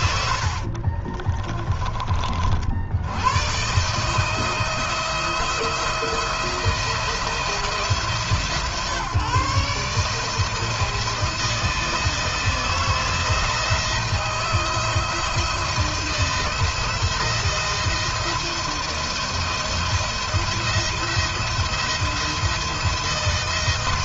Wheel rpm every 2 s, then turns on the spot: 60, 60, 160, 170, 140, 160, 160, 160, 170, 170, 170, 170.
0-2